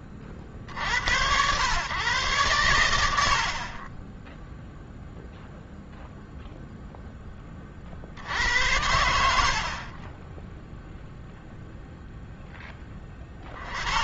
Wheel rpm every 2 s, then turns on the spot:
50, 110, 0, 0, 70, 0, 10.
none